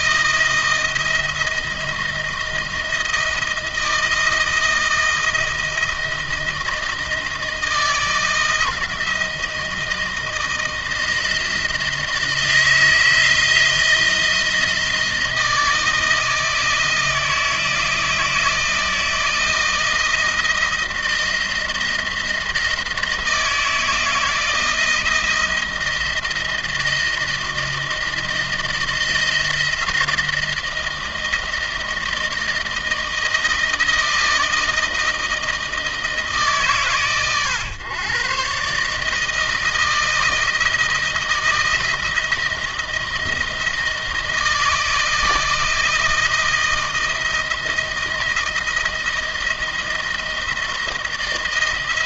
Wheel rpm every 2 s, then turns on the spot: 160, 160, 160, 160, 160, 160, 170, 170, 160, 160, 160, 160, 170, 160, 160, 160, 160, 160, 140, 140, 160, 160, 160, 160, 160, 160.
none